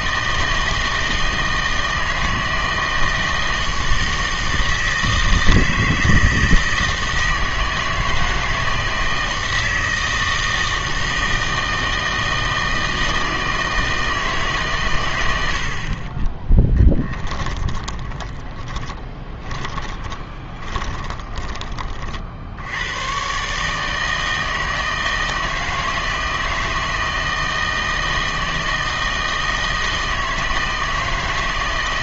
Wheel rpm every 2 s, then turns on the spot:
160, 160, 160, 160, 160, 160, 160, 130, 20, 20, 20, 80, 160, 160, 160, 160.
16-22